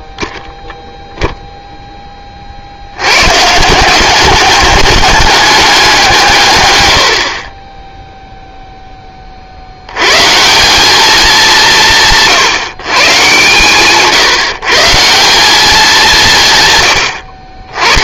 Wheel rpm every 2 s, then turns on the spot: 0, 80, 210, 100, 10, 200, 140, 160, 110.
none